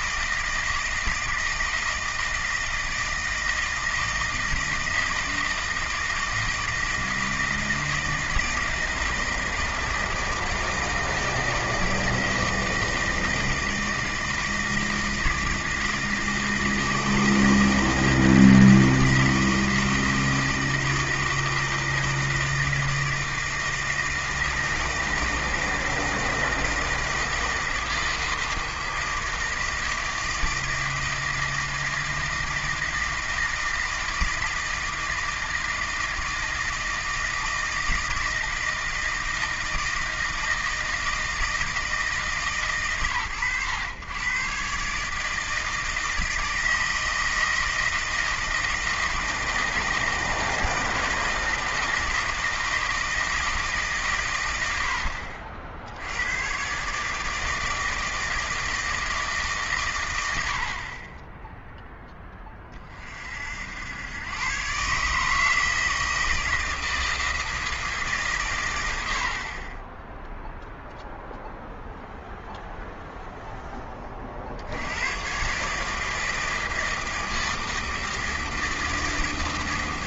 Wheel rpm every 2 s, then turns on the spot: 160, 160, 160, 160, 160, 160, 160, 160, 160, 160, 160, 160, 160, 160, 160, 160, 160, 160, 160, 160, 160, 130, 140, 160, 160, 160, 160, 90, 130, 160, 60, 30, 130, 160, 110, 0, 0, 80, 160, 160.
none